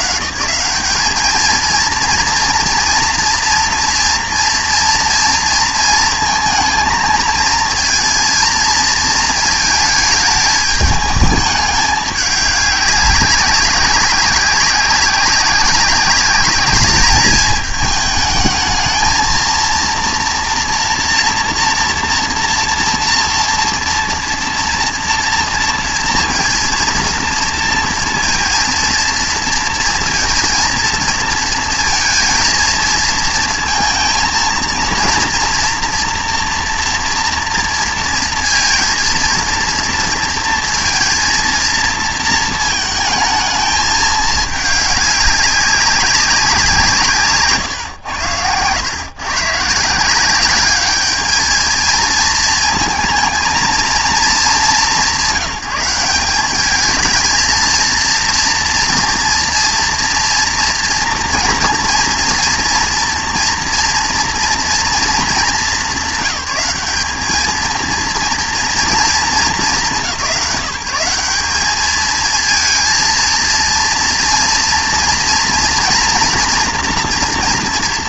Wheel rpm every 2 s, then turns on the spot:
150, 230, 240, 220, 220, 210, 200, 190, 200, 220, 240, 230, 230, 230, 220, 230, 230, 230, 230, 230, 230, 220, 210, 180, 100, 200, 220, 210, 210, 230, 230, 230, 240, 210, 240, 190, 230, 230, 240.
none